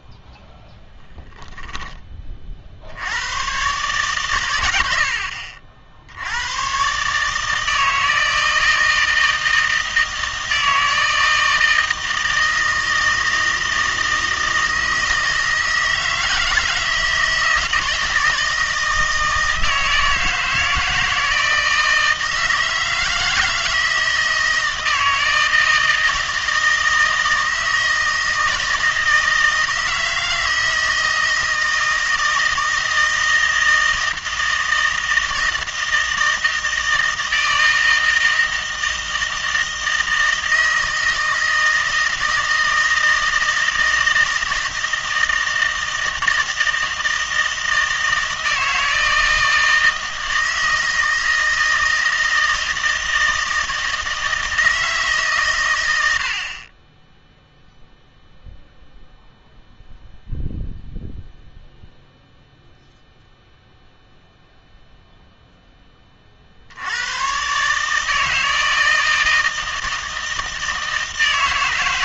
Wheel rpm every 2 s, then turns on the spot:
0, 60, 90, 120, 160, 160, 160, 160, 160, 160, 160, 160, 160, 160, 160, 160, 160, 160, 160, 160, 160, 160, 160, 160, 160, 160, 160, 150, 20, 0, 0, 0, 0, 80, 160, 160.
none